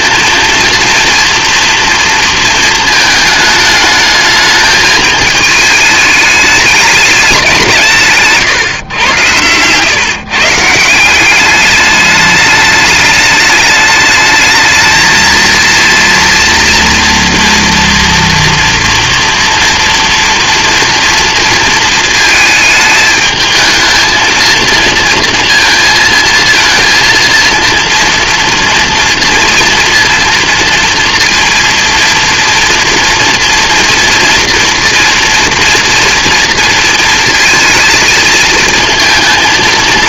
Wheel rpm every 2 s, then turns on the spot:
230, 220, 220, 210, 130, 170, 210, 220, 240, 230, 230, 220, 230, 230, 230, 230, 230, 230, 230, 230.
8-10